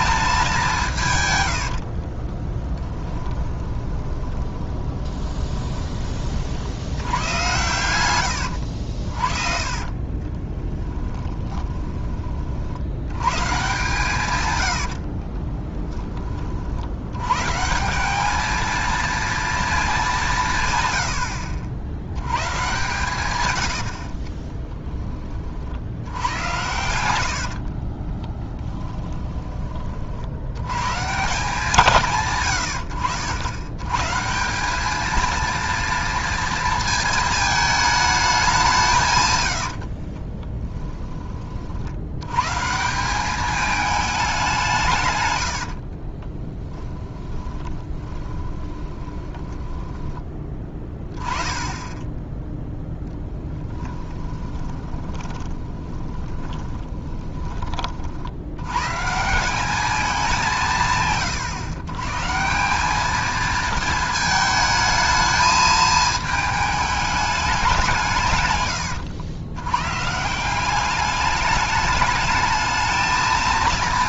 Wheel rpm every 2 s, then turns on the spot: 170, 20, 20, 80, 70, 20, 70, 80, 70, 220, 110, 130, 10, 100, 10, 120, 90, 200, 230, 170, 20, 160, 170, 10, 20, 20, 0, 20, 20, 120, 160, 190, 220, 210, 110, 200, 220.
2-6 8-12 14-16 26-30 40-42 46-50 54-58